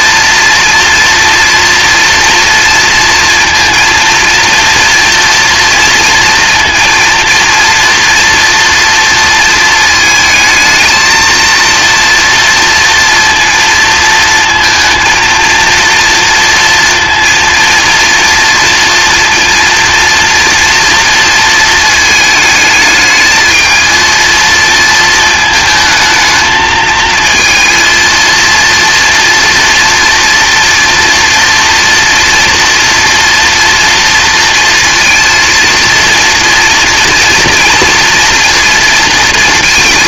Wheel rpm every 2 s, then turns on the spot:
230, 230, 230, 230, 230, 220, 230, 230, 230, 240, 230, 220, 220, 220, 230, 240, 230, 230, 230, 230.
none